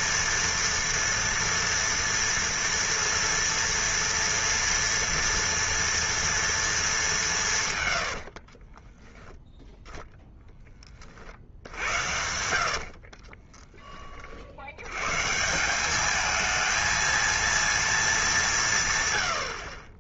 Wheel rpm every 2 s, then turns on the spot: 230, 230, 230, 220, 40, 10, 60, 90, 220, 170.
8-10 12-14